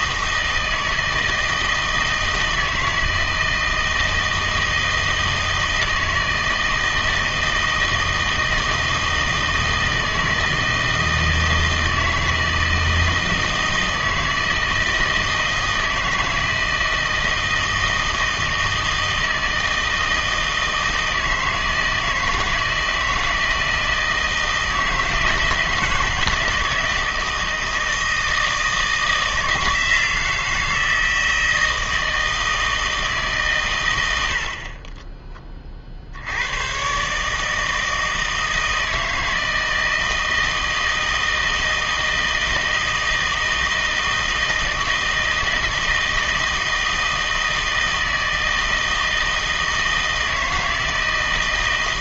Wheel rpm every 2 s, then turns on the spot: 160, 160, 160, 160, 160, 160, 160, 160, 160, 160, 160, 160, 160, 160, 160, 160, 160, 30, 110, 160, 160, 160, 160, 160, 160, 160.
none